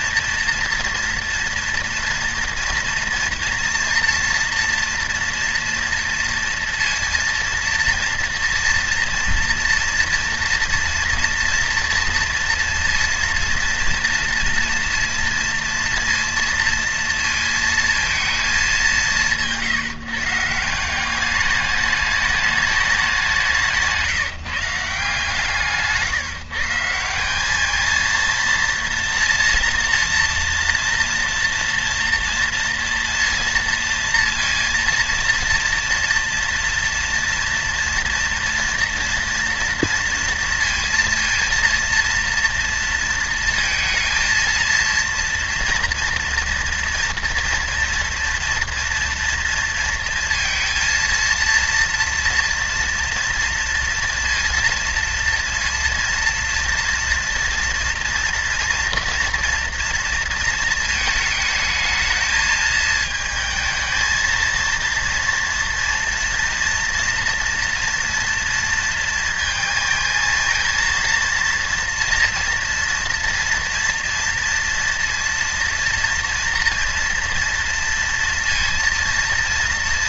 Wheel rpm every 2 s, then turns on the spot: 230, 240, 240, 230, 230, 230, 230, 230, 230, 200, 170, 210, 160, 160, 230, 240, 230, 230, 240, 240, 230, 230, 230, 230, 240, 230, 230, 230, 230, 230, 230, 220, 230, 230, 230, 230, 230, 230, 230, 230.
none